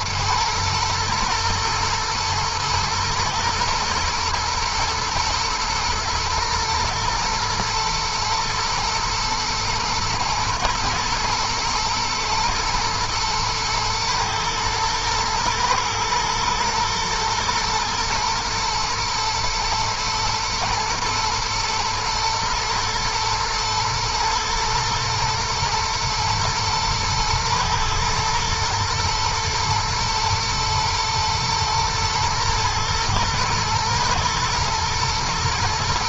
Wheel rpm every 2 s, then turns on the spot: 120, 110, 110, 110, 110, 120, 120, 110, 120, 110, 110, 110, 110, 110, 120, 120, 110, 110.
none